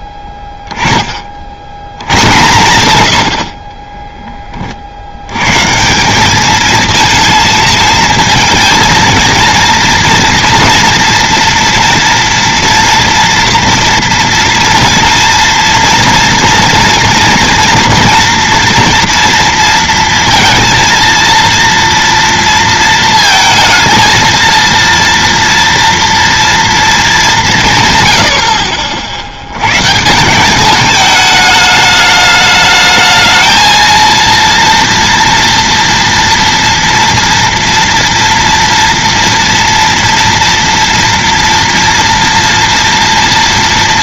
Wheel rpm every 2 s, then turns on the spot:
10, 110, 30, 220, 230, 230, 230, 230, 230, 230, 230, 230, 230, 230, 70, 200, 210, 230, 230, 230, 230, 230.
none